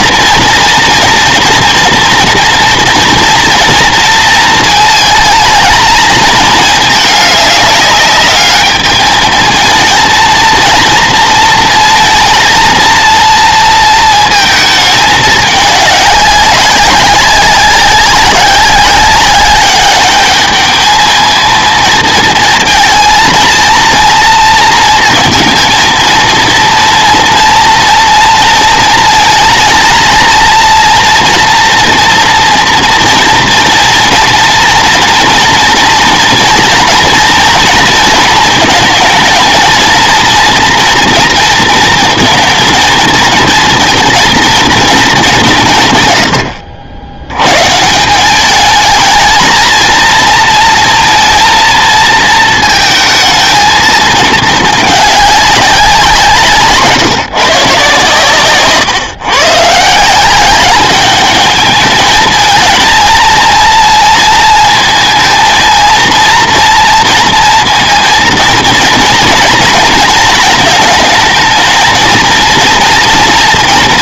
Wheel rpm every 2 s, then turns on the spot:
230, 230, 230, 220, 210, 230, 230, 220, 190, 190, 210, 220, 230, 230, 230, 230, 230, 230, 230, 220, 230, 230, 230, 90, 210, 230, 220, 220, 150, 140, 200, 220, 220, 230, 230, 220, 230.
58-60